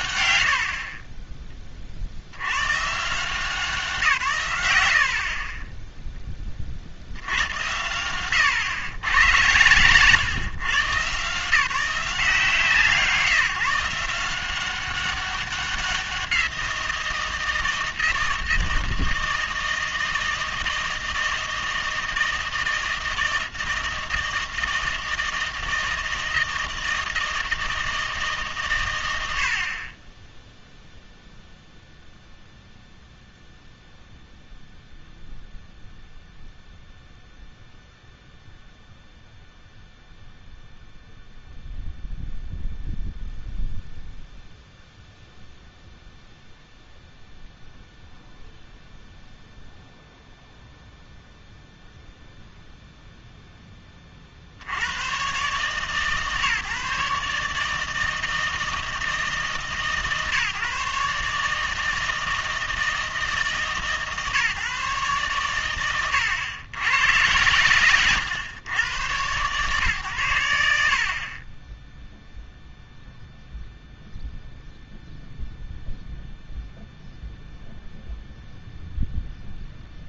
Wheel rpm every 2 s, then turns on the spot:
80, 100, 80, 30, 110, 130, 170, 190, 170, 160, 160, 160, 160, 160, 140, 0, 0, 0, 0, 0, 0, 0, 0, 0, 0, 0, 0, 70, 140, 160, 140, 160, 140, 100, 120, 70, 0, 0, 0, 0.
none